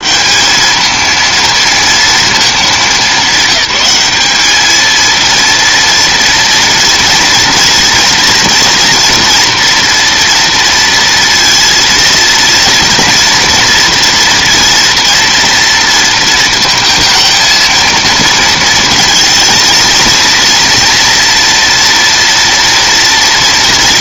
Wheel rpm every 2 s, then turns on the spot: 220, 210, 220, 230, 230, 230, 230, 230, 230, 230, 230, 230.
none